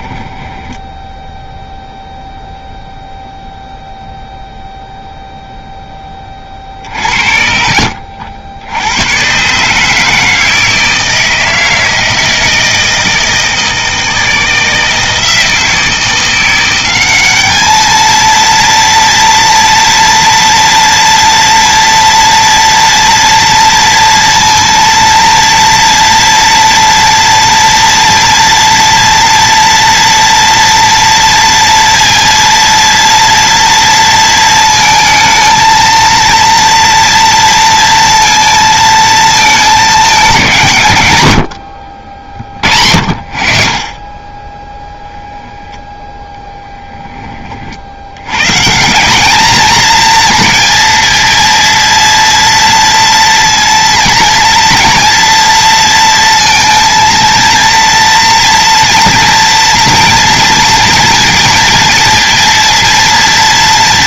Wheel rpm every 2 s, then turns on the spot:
10, 0, 0, 40, 90, 160, 160, 160, 190, 230, 230, 230, 230, 230, 230, 230, 230, 220, 230, 230, 150, 50, 10, 10, 160, 230, 230, 240, 230, 230, 230, 230.
6-8